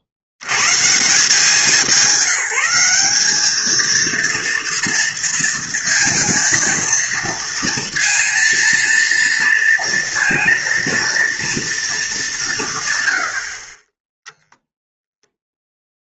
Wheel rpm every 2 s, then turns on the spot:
70, 190, 230, 230, 230, 230, 170, 0.
none